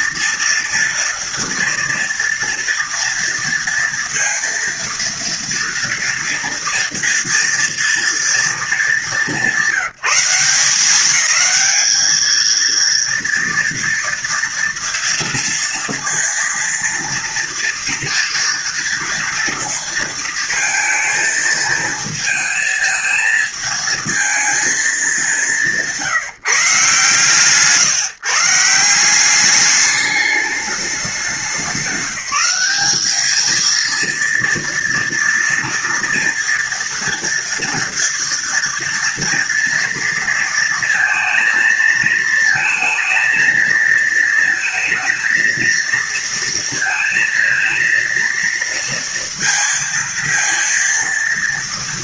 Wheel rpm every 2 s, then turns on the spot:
230, 230, 230, 230, 230, 180, 220, 230, 230, 230, 230, 230, 220, 150, 150, 210, 190, 230, 230, 230, 230, 230, 230, 230, 230, 230.
none